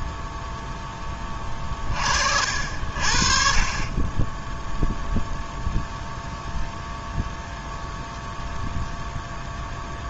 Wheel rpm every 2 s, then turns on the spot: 10, 60, 0, 0, 0.
none